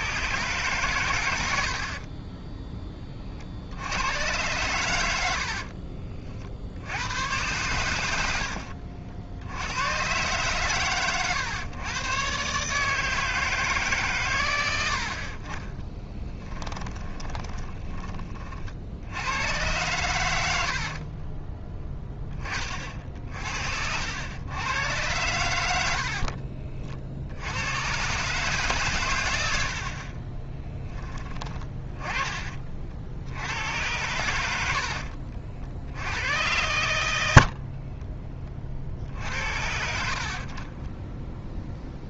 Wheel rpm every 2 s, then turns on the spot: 120, 20, 100, 80, 60, 120, 150, 80, 20, 70, 60, 50, 110, 60, 130, 10, 60, 80, 90, 60, 20.
16-18 20-22 34-36 40-42